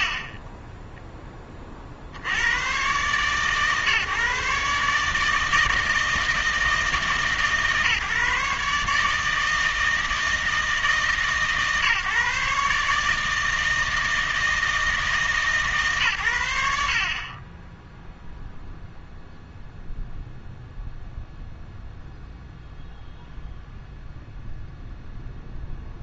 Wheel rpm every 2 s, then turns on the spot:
50, 110, 140, 160, 150, 160, 150, 160, 80, 0, 0, 0, 0.
none